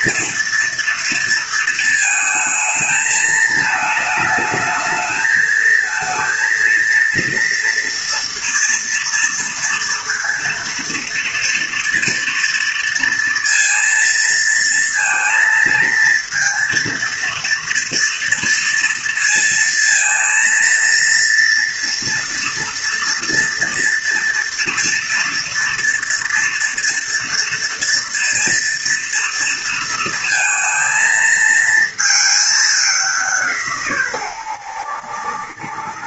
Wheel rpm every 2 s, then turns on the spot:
230, 220, 220, 230, 230, 230, 230, 230, 230, 230, 230, 230, 230, 230, 230, 220, 200, 90.
none